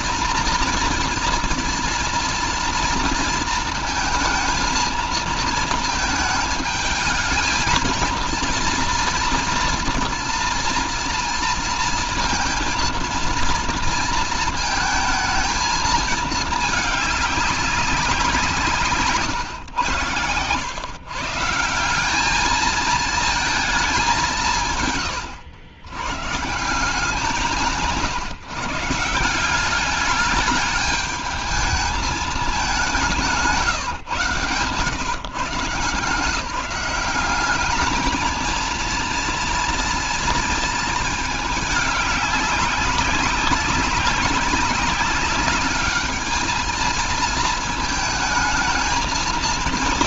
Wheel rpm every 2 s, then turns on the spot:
230, 230, 220, 220, 230, 230, 230, 230, 210, 150, 100, 220, 170, 160, 150, 210, 200, 130, 170, 220, 230, 200, 200, 220, 220.
none